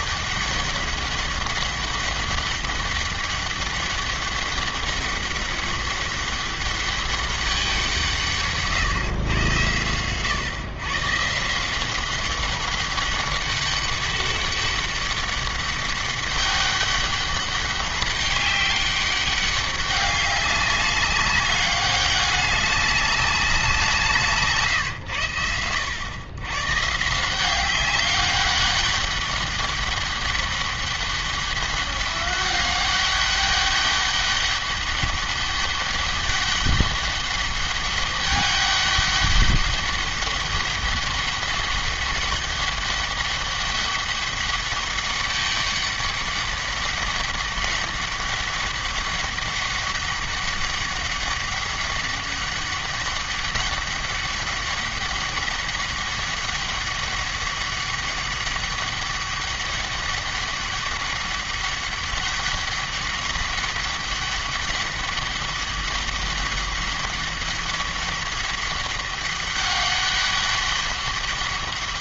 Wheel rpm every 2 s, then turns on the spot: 200, 200, 200, 200, 150, 130, 200, 200, 200, 200, 200, 200, 130, 140, 200, 200, 200, 200, 200, 200, 200, 200, 200, 200, 200, 200, 200, 200, 200, 200, 200, 200, 200, 200, 200, 200.
none